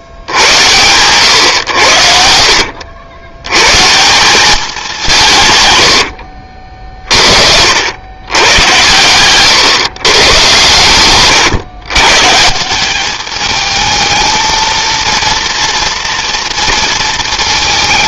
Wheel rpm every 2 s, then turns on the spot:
100, 80, 190, 40, 100, 120, 190, 230, 230.
none